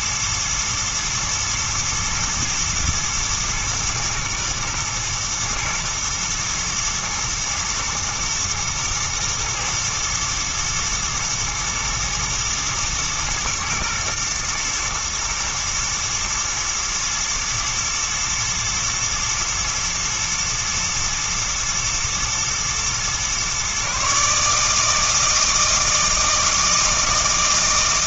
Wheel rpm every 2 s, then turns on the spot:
110, 110, 120, 120, 120, 110, 110, 110, 110, 120, 120, 120, 150, 160.
none